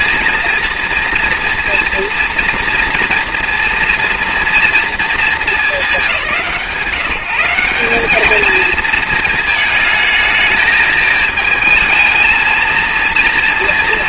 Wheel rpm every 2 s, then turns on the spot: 230, 230, 230, 170, 220, 220, 230.
none